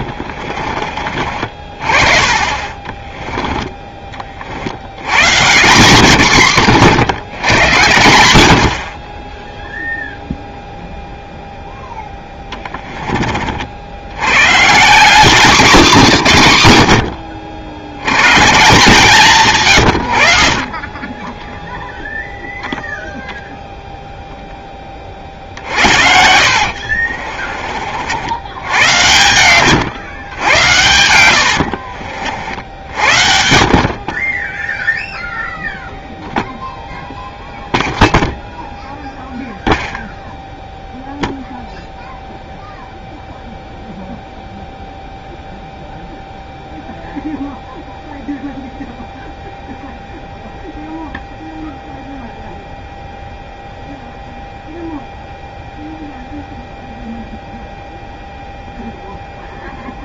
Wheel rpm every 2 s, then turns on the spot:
40, 30, 80, 120, 70, 0, 10, 150, 110, 150, 40, 0, 10, 60, 100, 100, 60, 0, 0, 0, 0, 0, 0, 0, 0, 0, 0, 0, 0, 0.
26-28 30-32